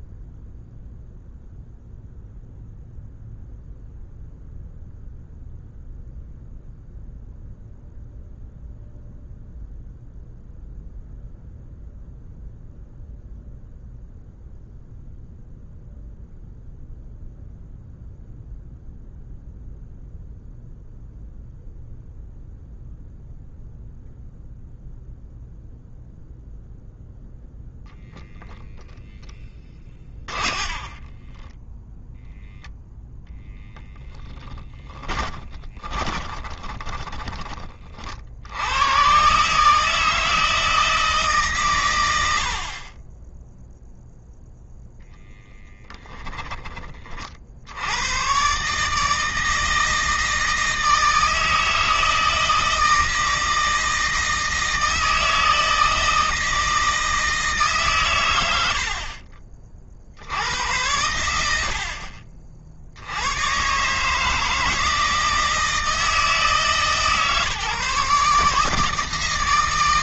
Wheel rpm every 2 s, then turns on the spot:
0, 0, 0, 0, 0, 0, 0, 0, 0, 0, 0, 0, 0, 0, 10, 20, 0, 20, 20, 110, 160, 30, 0, 30, 150, 160, 160, 160, 160, 60, 100, 60, 160, 150, 160.
28-32 34-38